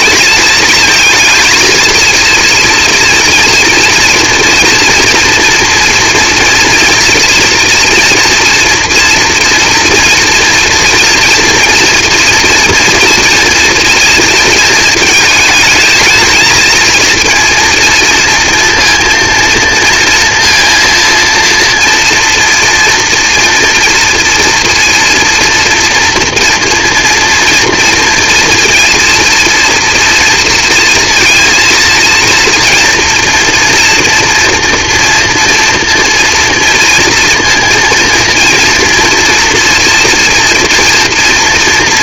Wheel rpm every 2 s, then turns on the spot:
220, 230, 230, 230, 230, 230, 230, 220, 220, 230, 230, 230, 230, 230, 230, 230, 230, 240, 230, 230, 230.
none